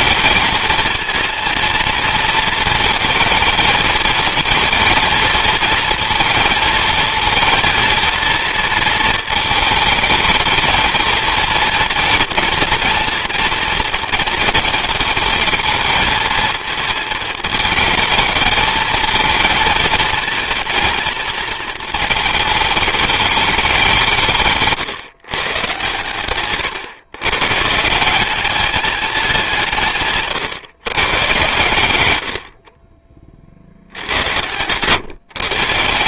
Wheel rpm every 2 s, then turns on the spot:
220, 220, 230, 230, 230, 220, 240, 230, 220, 220, 220, 210, 140, 120, 210, 140, 40, 110.
none